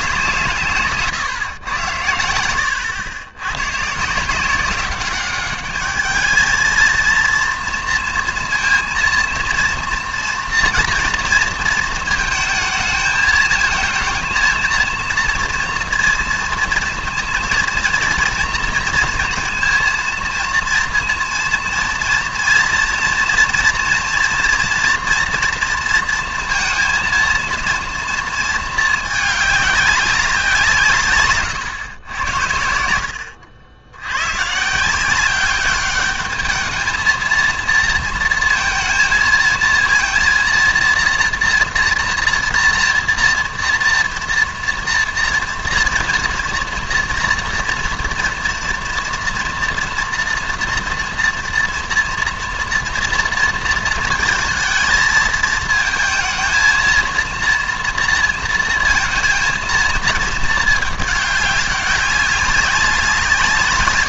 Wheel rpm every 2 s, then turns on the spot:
160, 100, 180, 220, 230, 230, 220, 230, 230, 230, 230, 230, 230, 230, 220, 180, 70, 150, 210, 230, 230, 230, 240, 230, 230, 230, 230, 220, 220, 230, 220, 190.
none